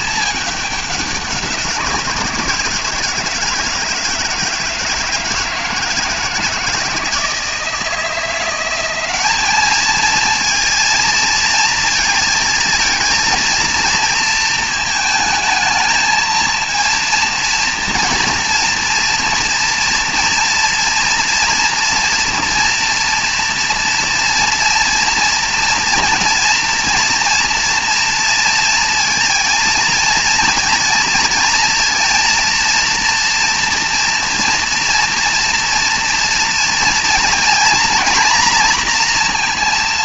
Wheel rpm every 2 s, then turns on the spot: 200, 160, 160, 160, 180, 230, 230, 230, 230, 230, 230, 240, 230, 230, 230, 230, 230, 230, 230, 240.
none